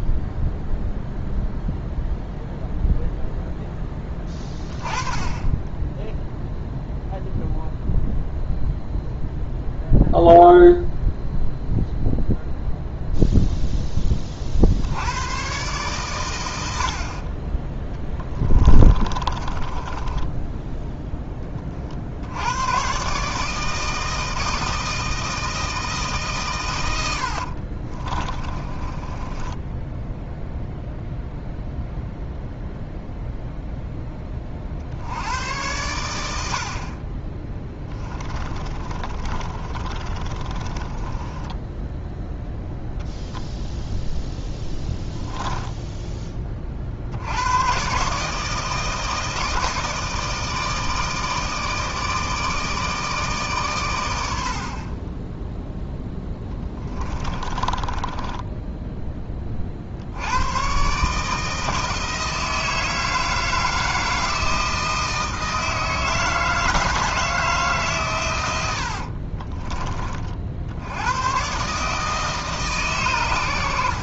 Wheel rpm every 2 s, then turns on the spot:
0, 0, 30, 0, 0, 0, 0, 70, 50, 30, 10, 120, 160, 100, 20, 0, 0, 80, 50, 30, 20, 0, 0, 60, 160, 160, 160, 30, 20, 10, 140, 160, 160, 160, 70, 90, 130.
18-20 28-30 38-42 54-58 68-70